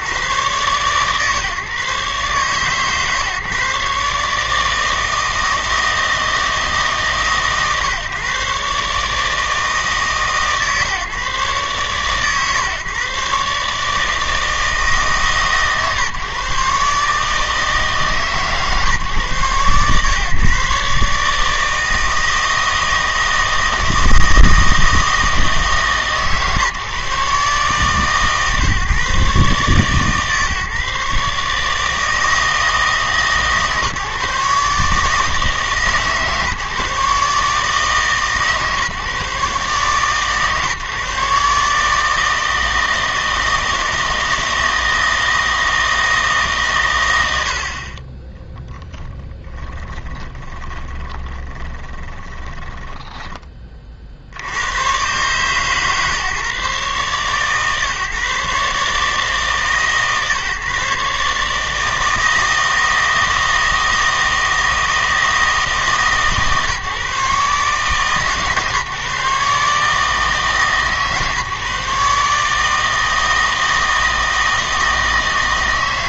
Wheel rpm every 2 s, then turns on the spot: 130, 140, 150, 160, 140, 140, 130, 160, 140, 140, 140, 160, 160, 150, 140, 140, 160, 150, 150, 150, 140, 160, 160, 130, 20, 20, 10, 100, 140, 140, 140, 160, 160, 140, 140, 150, 150, 160.
50-54